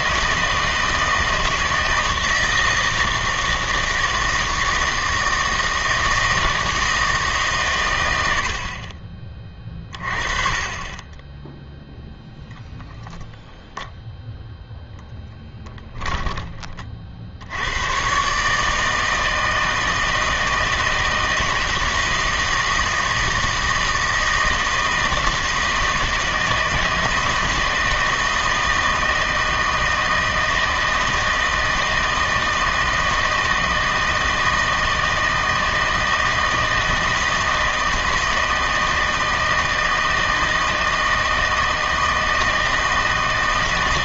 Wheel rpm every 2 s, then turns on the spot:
160, 160, 160, 160, 50, 30, 0, 0, 40, 150, 160, 160, 160, 160, 160, 160, 160, 160, 160, 160, 160, 160.
none